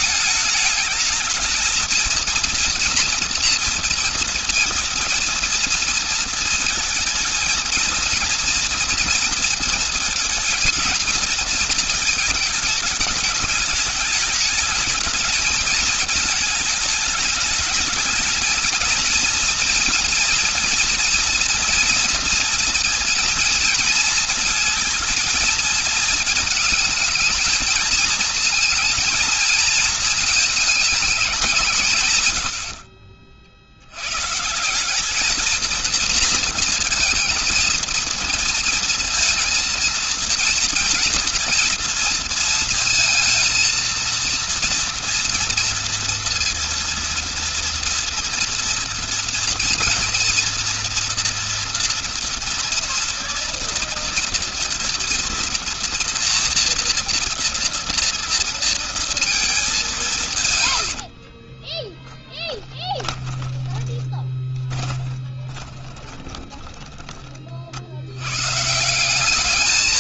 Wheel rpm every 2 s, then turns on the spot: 220, 230, 230, 220, 230, 230, 220, 210, 220, 220, 240, 230, 230, 220, 220, 220, 80, 160, 230, 230, 230, 230, 230, 230, 230, 230, 230, 230, 230, 230, 140, 20, 20, 30, 110.
62-68